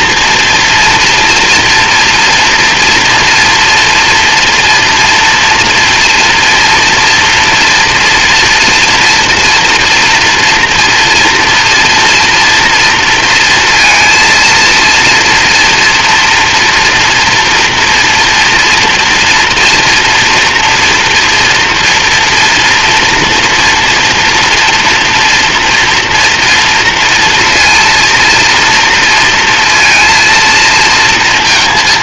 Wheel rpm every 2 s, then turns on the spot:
230, 230, 230, 230, 240, 230, 230, 230, 230, 230, 240, 240, 240, 230, 230, 230.
none